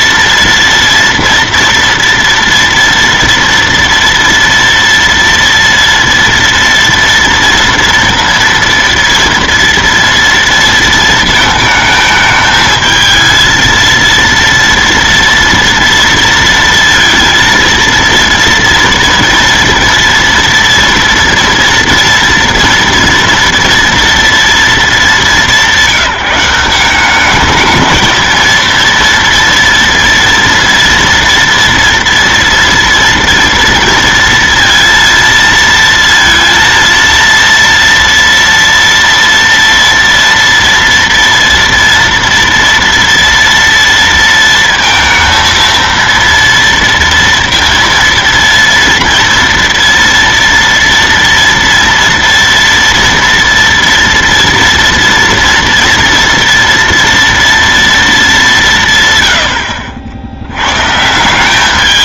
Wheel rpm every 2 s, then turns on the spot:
230, 230, 230, 230, 230, 230, 220, 230, 230, 230, 230, 230, 230, 190, 230, 230, 230, 230, 230, 230, 230, 230, 230, 230, 230, 230, 240, 230, 230, 180, 100.
none